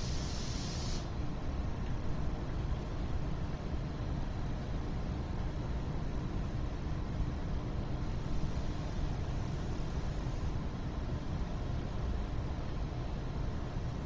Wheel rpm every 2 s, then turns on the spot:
0, 0, 0, 0, 0, 0, 0.
none